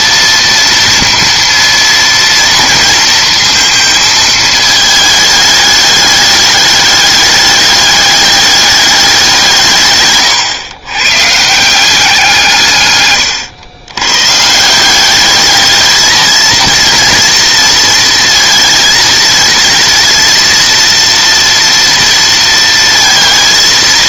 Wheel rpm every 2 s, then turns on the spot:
230, 230, 220, 210, 210, 120, 140, 170, 230, 230, 230, 230.
none